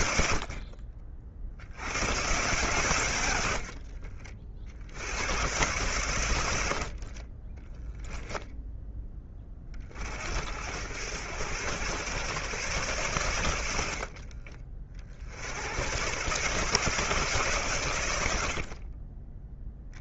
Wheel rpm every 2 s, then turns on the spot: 60, 140, 60, 80, 10, 80, 120, 40, 140, 70.
0-2 6-8 18-20